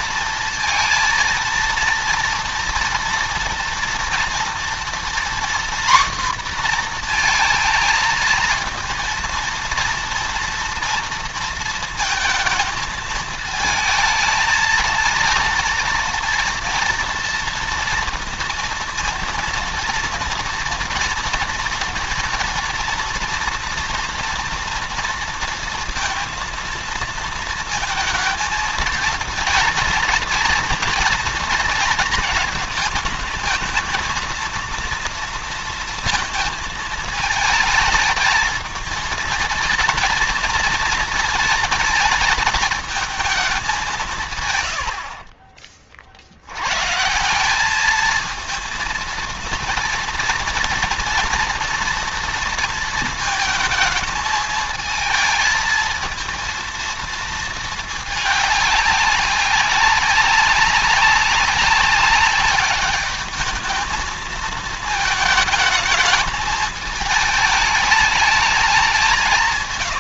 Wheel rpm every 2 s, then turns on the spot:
230, 230, 230, 240, 230, 230, 230, 230, 230, 230, 230, 230, 230, 230, 230, 240, 220, 230, 220, 220, 230, 220, 130, 90, 220, 230, 230, 220, 230, 210, 200, 200, 220, 210, 210.
44-46